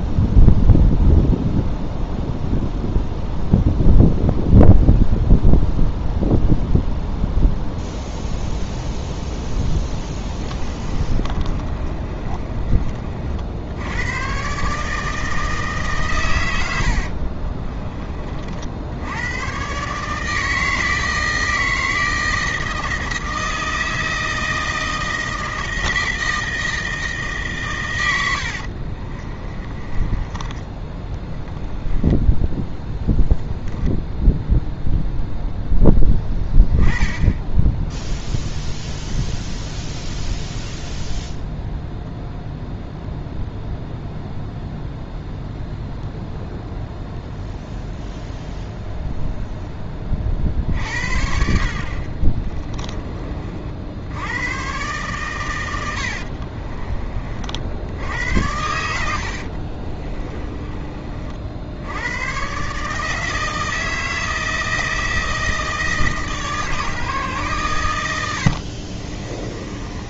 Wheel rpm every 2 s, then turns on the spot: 0, 0, 0, 0, 0, 20, 40, 150, 80, 70, 160, 160, 160, 160, 50, 20, 10, 0, 10, 0, 0, 0, 0, 0, 0, 50, 20, 120, 30, 90, 30, 140, 160, 150, 50.
10-12 16-18 28-30 32-34 56-60 68-70